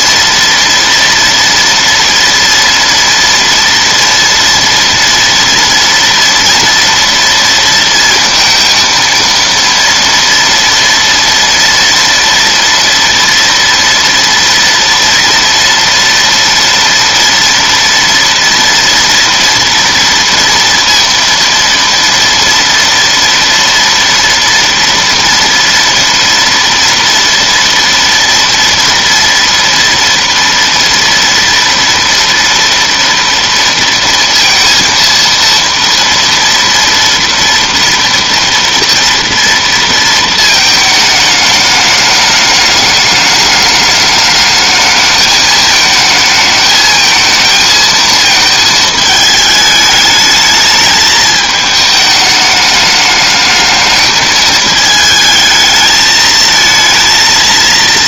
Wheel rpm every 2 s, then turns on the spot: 230, 230, 230, 230, 230, 230, 230, 230, 230, 230, 230, 230, 240, 230, 230, 230, 230, 230, 240, 240, 220, 210, 220, 220, 220, 220, 210, 220, 230.
none